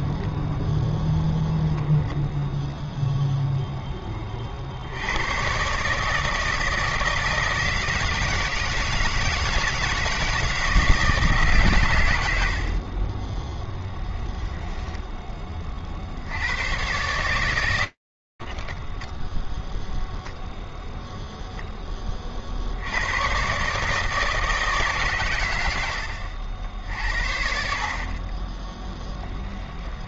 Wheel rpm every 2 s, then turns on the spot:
0, 0, 50, 160, 160, 160, 50, 10, 130, 10, 0, 40, 150, 80, 20.
12-14